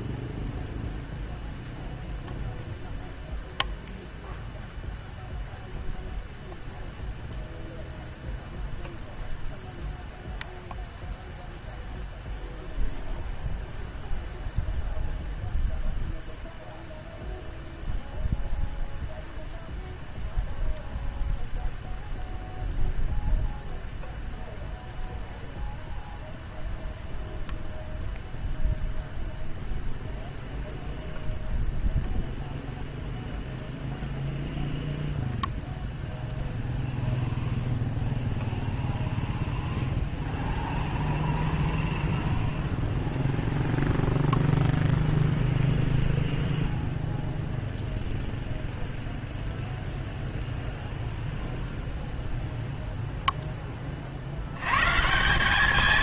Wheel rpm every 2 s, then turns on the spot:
0, 0, 0, 0, 0, 0, 0, 0, 0, 0, 0, 0, 0, 0, 0, 0, 0, 0, 0, 0, 0, 0, 0, 0, 0, 0, 0, 100.
none